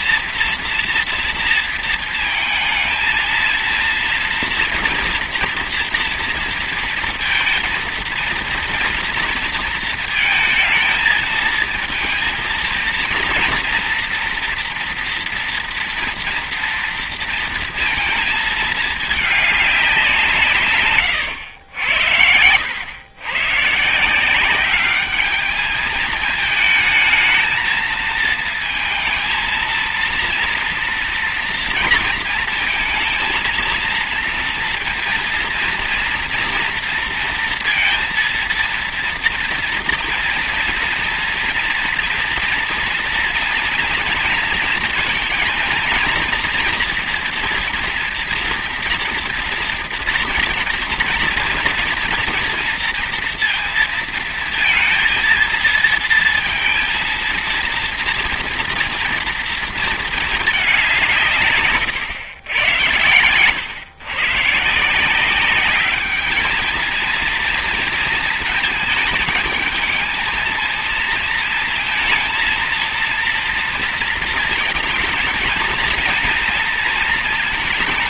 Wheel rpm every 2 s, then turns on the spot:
230, 230, 230, 230, 230, 220, 230, 240, 230, 210, 120, 100, 200, 220, 230, 240, 230, 230, 230, 230, 230, 230, 230, 230, 230, 230, 230, 230, 230, 230, 180, 90, 170, 230, 220, 220, 230, 220, 230.
none